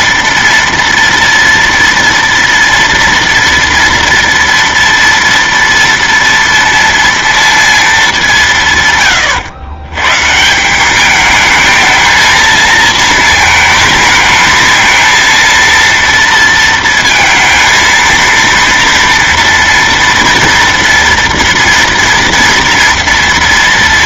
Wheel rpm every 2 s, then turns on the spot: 230, 230, 230, 230, 150, 170, 230, 220, 230, 230, 230, 230.
none